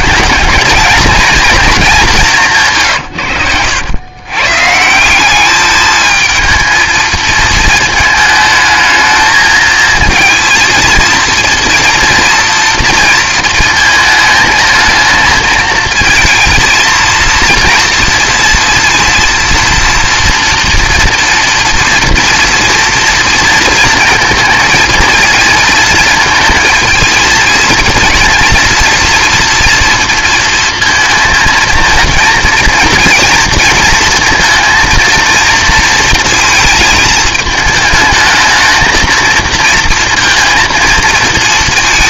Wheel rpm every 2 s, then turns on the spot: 230, 160, 150, 220, 220, 230, 230, 220, 220, 230, 230, 240, 230, 230, 230, 230, 230, 230, 230, 220, 230.
2-4